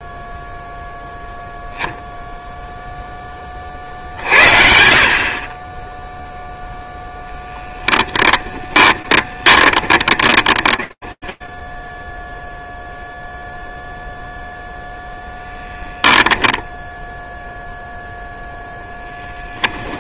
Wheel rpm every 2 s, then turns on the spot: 0, 0, 60, 0, 20, 10, 0, 0, 0, 0.
8-12